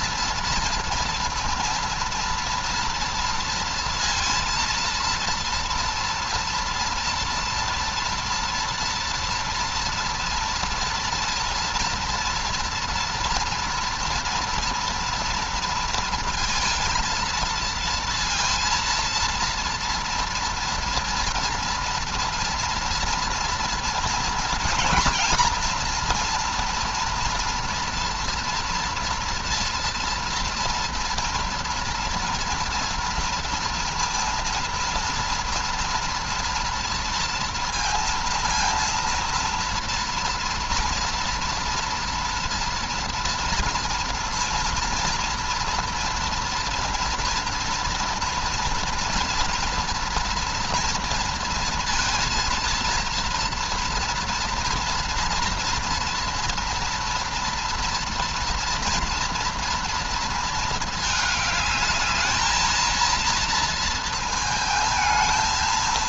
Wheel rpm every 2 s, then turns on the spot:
230, 230, 230, 240, 230, 230, 230, 230, 230, 230, 230, 230, 230, 230, 230, 230, 230, 230, 240, 240, 230, 230, 230, 240, 230, 230, 230, 230, 230, 230, 220, 220, 220.
none